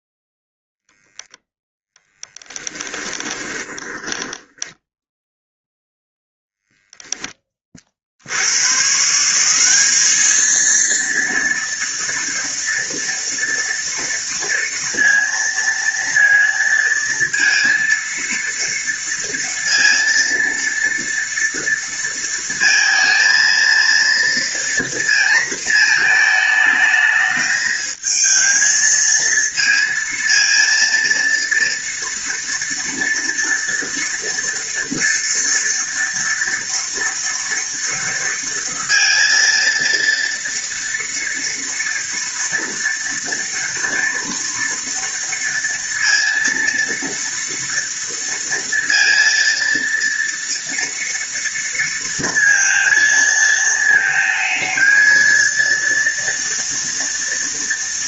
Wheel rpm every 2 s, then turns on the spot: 0, 10, 10, 0, 150, 230, 230, 230, 230, 230, 230, 230, 230, 220, 220, 230, 230, 230, 230, 230, 230, 230, 230, 230, 230, 230, 230, 220, 230.
2-4